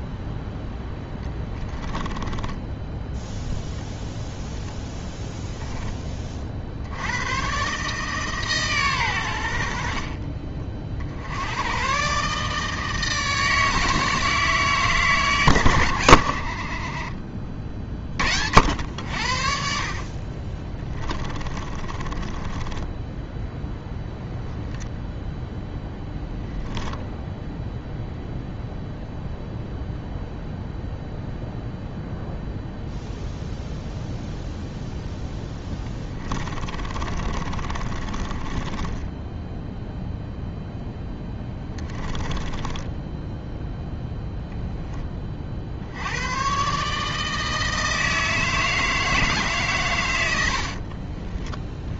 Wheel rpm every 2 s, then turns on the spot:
10, 10, 10, 70, 130, 50, 160, 150, 40, 80, 20, 10, 30, 10, 0, 0, 0, 0, 30, 20, 0, 10, 20, 150, 160, 50.
2-4 20-22 24-26 36-40 42-44 50-52